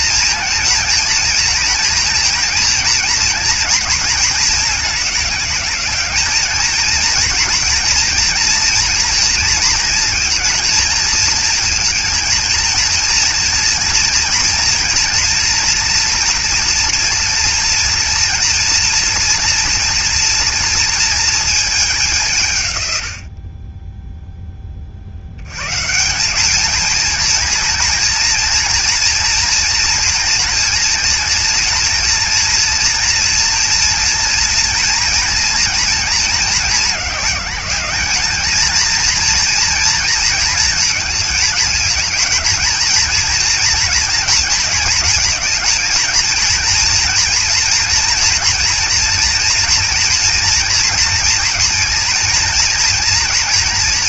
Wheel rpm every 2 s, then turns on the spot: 230, 240, 210, 230, 230, 230, 230, 230, 230, 240, 230, 100, 40, 220, 230, 230, 230, 230, 200, 230, 220, 230, 220, 230, 230, 230, 230.
none